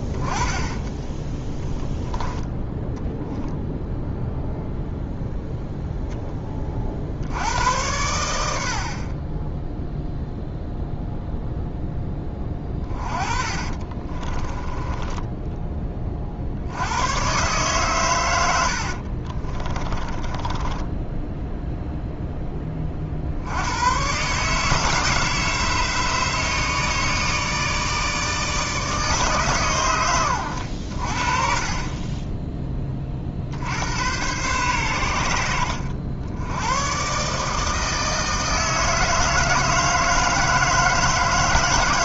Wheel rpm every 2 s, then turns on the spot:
10, 10, 0, 30, 70, 0, 20, 10, 80, 70, 10, 20, 150, 160, 160, 90, 20, 110, 110, 160, 160.
0-4 12-14 18-22